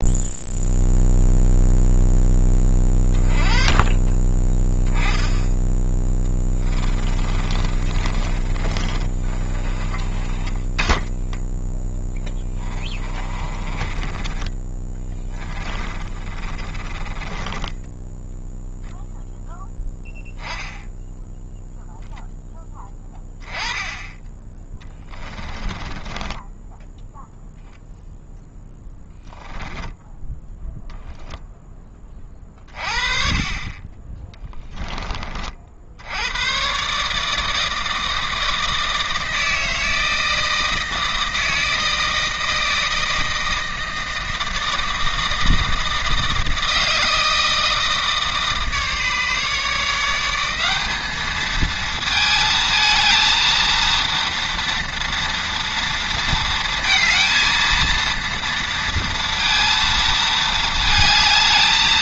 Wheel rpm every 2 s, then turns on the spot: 0, 20, 10, 20, 30, 10, 30, 20, 20, 0, 10, 10, 10, 10, 10, 0, 30, 20, 130, 160, 160, 160, 160, 160, 150, 200, 220, 230, 230, 230, 220.
6-10 12-18 24-30